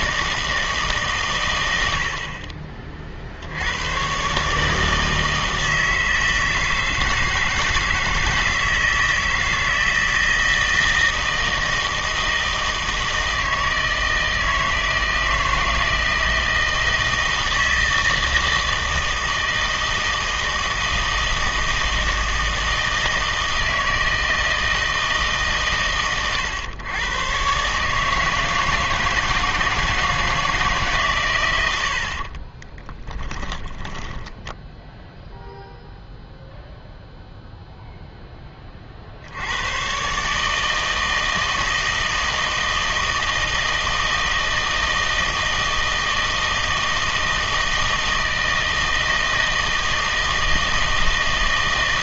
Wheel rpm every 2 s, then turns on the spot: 160, 40, 150, 160, 160, 160, 160, 160, 160, 160, 160, 160, 160, 110, 160, 150, 20, 10, 0, 30, 150, 160, 160, 160, 160, 160.
32-34